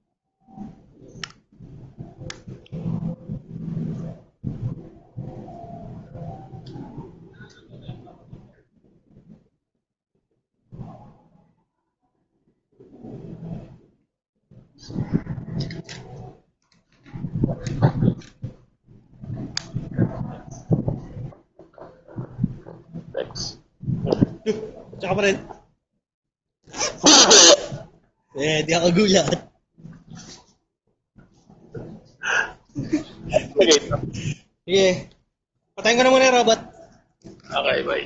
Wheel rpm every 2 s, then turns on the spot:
0, 0, 0, 0, 0, 0, 0, 0, 0, 0, 0, 0, 0, 0, 0, 0, 0, 0, 0.
none